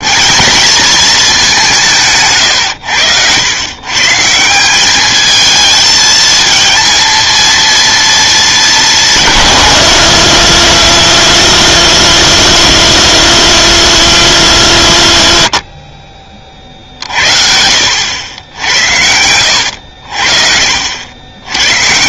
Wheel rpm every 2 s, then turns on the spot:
220, 100, 200, 230, 210, 190, 180, 120, 50, 70, 60.
none